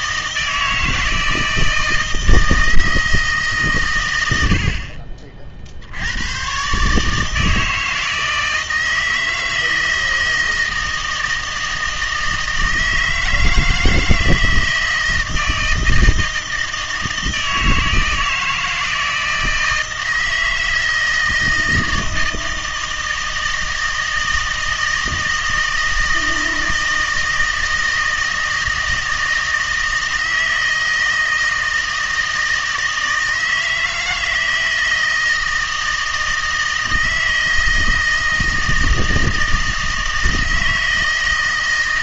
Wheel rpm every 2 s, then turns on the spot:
160, 160, 70, 130, 160, 160, 160, 160, 160, 160, 160, 160, 160, 160, 160, 160, 160, 160, 160, 160, 160.
none